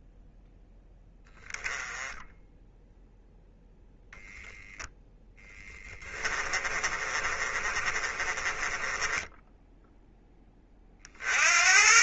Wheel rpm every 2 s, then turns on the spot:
0, 0, 0, 30, 20, 20.
6-10